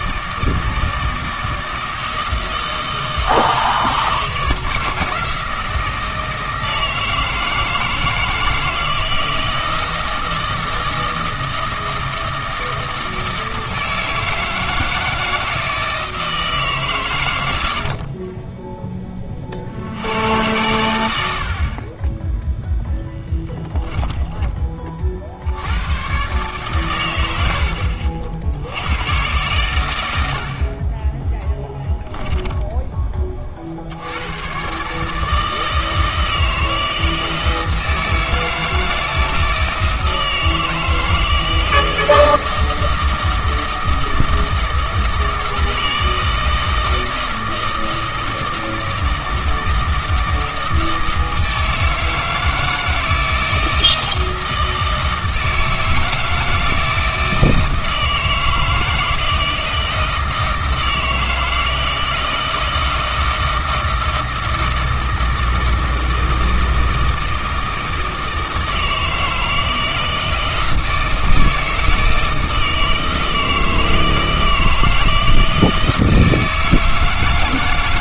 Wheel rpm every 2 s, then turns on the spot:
160, 160, 160, 160, 160, 160, 160, 160, 120, 10, 100, 0, 30, 110, 90, 40, 10, 130, 160, 160, 160, 160, 160, 160, 160, 160, 160, 160, 160, 160, 160, 160, 160, 160, 160, 160, 160, 160, 160.
none